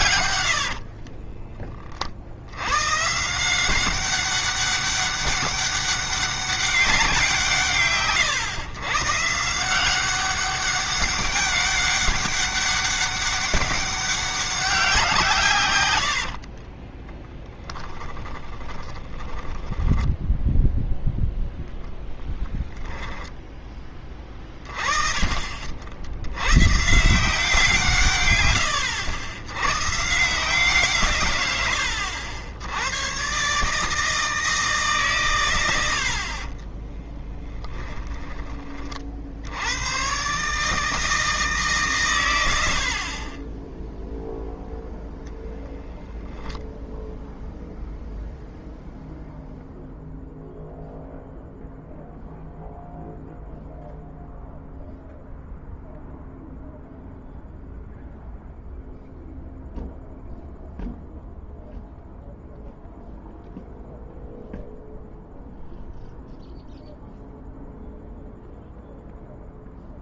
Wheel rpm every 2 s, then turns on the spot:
60, 120, 200, 190, 140, 200, 200, 190, 50, 10, 0, 10, 20, 150, 100, 150, 90, 150, 20, 40, 150, 70, 0, 0, 0, 0, 0, 0, 0, 0, 0, 0, 0, 0, 0.
0-2 16-20 36-38